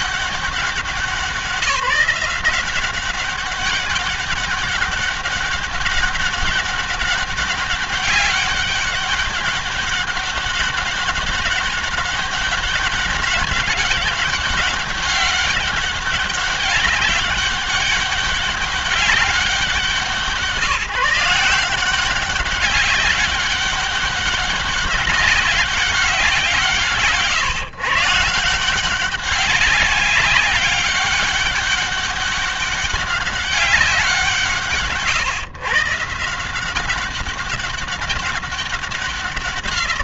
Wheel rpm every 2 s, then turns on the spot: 180, 180, 200, 200, 200, 200, 200, 200, 200, 200, 160, 200, 200, 160, 170, 200, 200, 150, 180, 200.
none